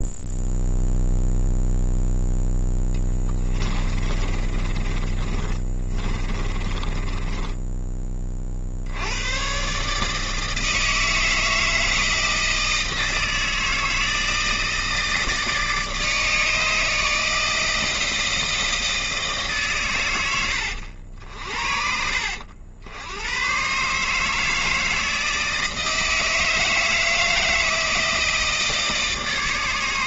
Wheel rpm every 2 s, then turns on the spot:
0, 10, 30, 20, 60, 160, 160, 160, 150, 160, 90, 80, 160, 160, 160.
4-8